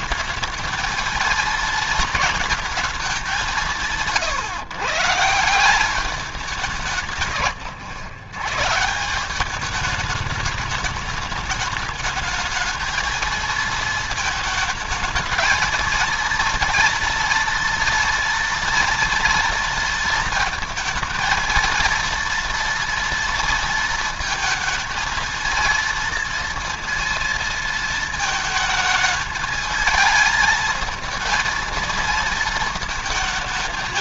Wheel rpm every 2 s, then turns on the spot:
220, 220, 150, 170, 130, 210, 210, 220, 230, 230, 230, 230, 220, 230, 220, 220, 220.
none